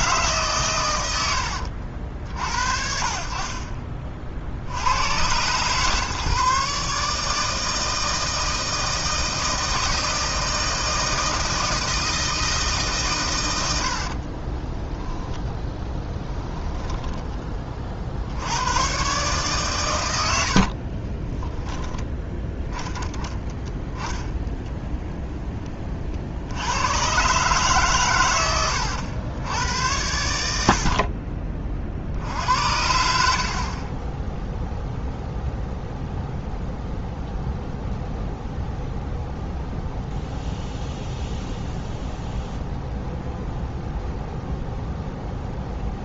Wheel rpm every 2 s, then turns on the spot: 110, 50, 80, 140, 160, 160, 140, 10, 10, 120, 50, 10, 0, 100, 100, 50, 70, 0, 0, 0, 0, 0, 0.
14-18 20-22